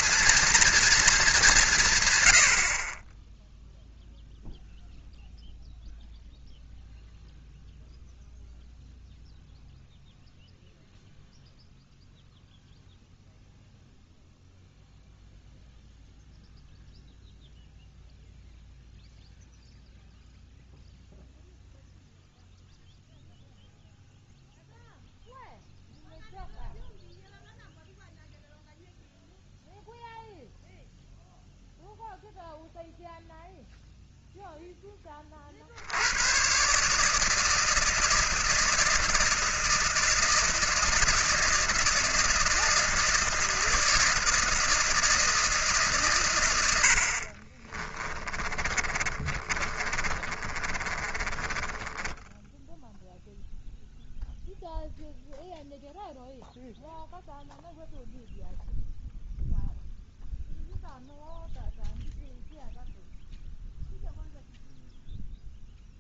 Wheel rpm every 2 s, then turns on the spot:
240, 50, 0, 0, 0, 0, 0, 0, 0, 0, 0, 0, 0, 0, 0, 0, 0, 0, 140, 160, 160, 160, 160, 80, 20, 20, 0, 0, 0, 0, 0, 0, 0.
46-52